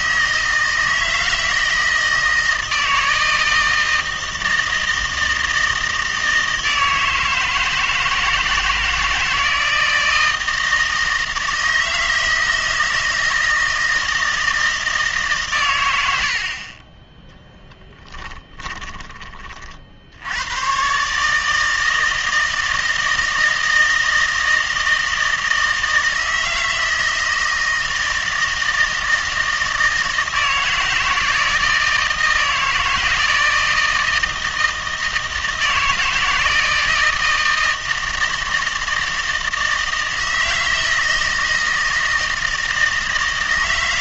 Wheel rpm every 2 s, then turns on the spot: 160, 160, 160, 160, 160, 160, 160, 160, 30, 20, 120, 160, 160, 160, 160, 160, 160, 160, 160, 160, 160, 160.
16-20